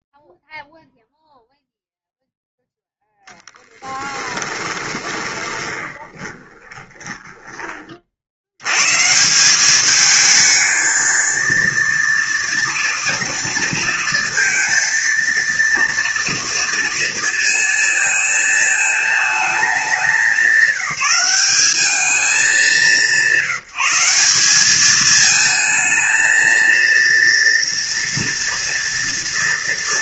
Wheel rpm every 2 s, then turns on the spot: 0, 10, 20, 20, 160, 230, 230, 230, 220, 220, 210, 180, 220, 230, 230.
4-8